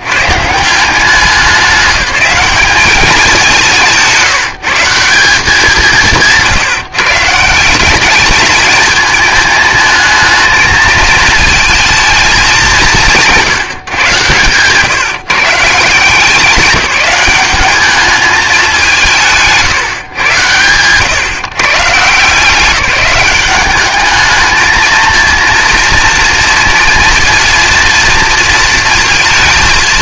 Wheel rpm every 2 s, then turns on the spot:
140, 200, 160, 160, 210, 220, 200, 130, 190, 200, 110, 180, 220, 230, 230.
14-16